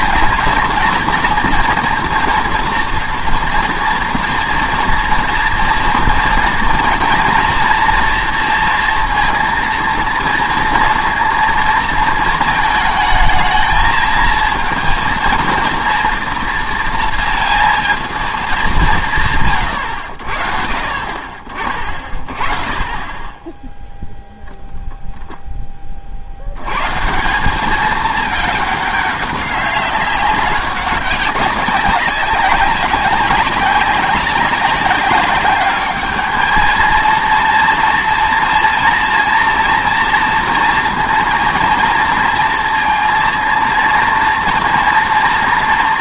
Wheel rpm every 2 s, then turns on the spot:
230, 230, 230, 230, 240, 230, 220, 230, 230, 190, 60, 20, 0, 100, 210, 200, 190, 200, 220, 230, 230, 230, 230.
none